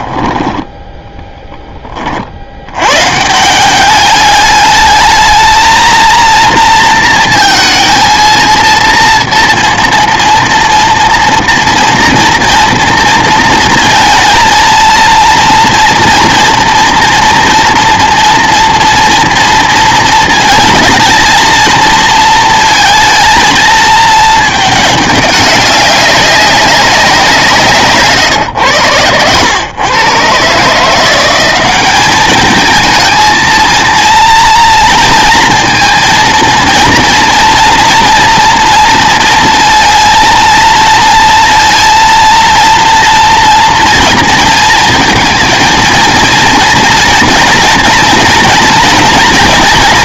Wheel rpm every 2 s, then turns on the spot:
10, 100, 210, 230, 230, 230, 230, 230, 230, 230, 230, 230, 210, 190, 110, 150, 220, 230, 230, 240, 230, 230, 230, 230, 230.
0-2